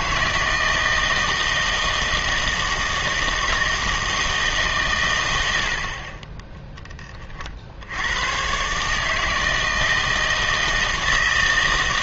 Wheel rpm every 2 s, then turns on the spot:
160, 160, 140, 10, 140, 160.
none